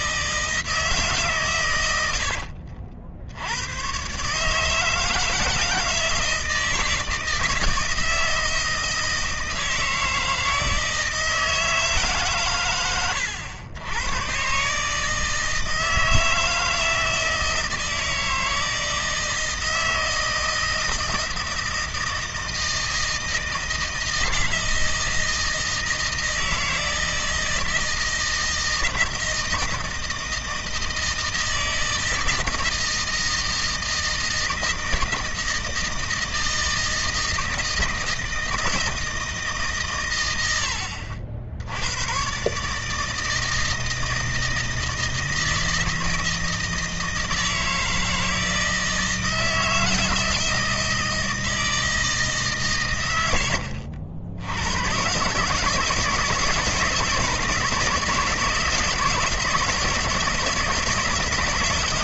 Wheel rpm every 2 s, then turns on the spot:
160, 80, 160, 160, 160, 160, 110, 150, 160, 160, 160, 160, 160, 160, 160, 160, 160, 160, 160, 160, 70, 150, 160, 160, 160, 160, 120, 110, 160, 160, 160.
none